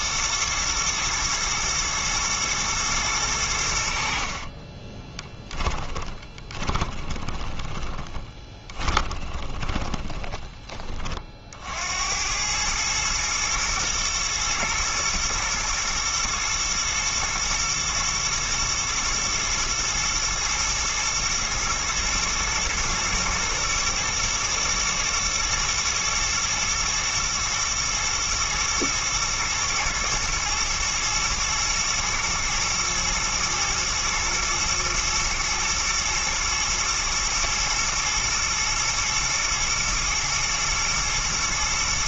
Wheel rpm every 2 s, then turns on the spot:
120, 110, 30, 30, 30, 20, 110, 110, 120, 120, 110, 110, 110, 120, 110, 110, 110, 120, 120, 110, 120.
4-10